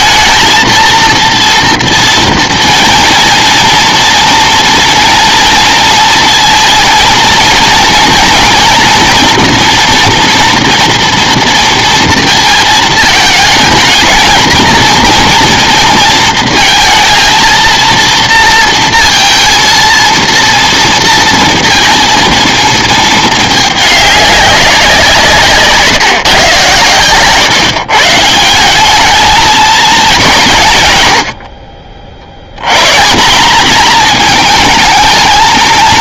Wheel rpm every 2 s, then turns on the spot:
230, 230, 230, 220, 240, 230, 220, 220, 230, 230, 230, 220, 190, 120, 180, 150, 110, 210.
none